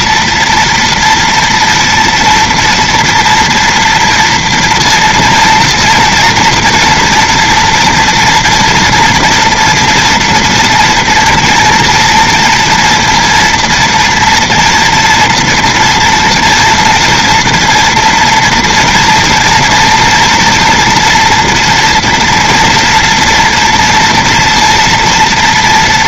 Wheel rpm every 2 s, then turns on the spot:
230, 230, 230, 230, 230, 230, 230, 230, 230, 240, 230, 230, 240.
none